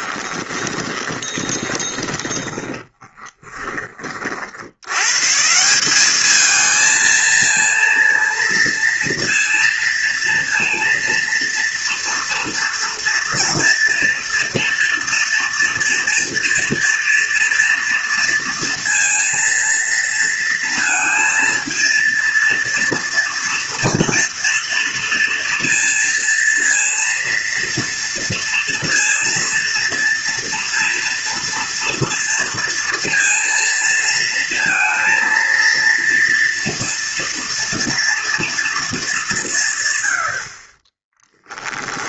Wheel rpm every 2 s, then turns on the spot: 20, 30, 110, 220, 230, 230, 230, 230, 230, 230, 230, 230, 230, 230, 230, 230, 230, 230, 230, 210, 30.
0-4 40-42